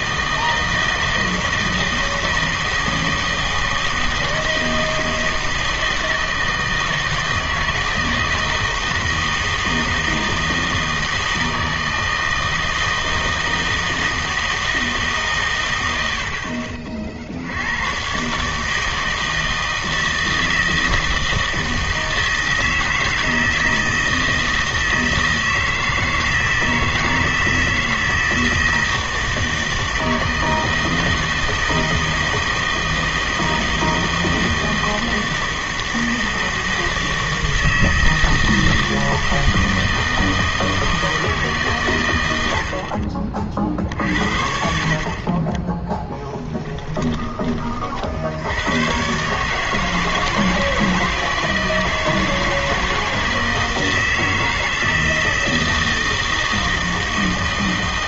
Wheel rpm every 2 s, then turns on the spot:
160, 160, 160, 160, 160, 160, 160, 160, 50, 160, 160, 160, 160, 160, 160, 160, 160, 160, 160, 160, 160, 70, 60, 20, 100, 160, 160, 160, 160.
46-48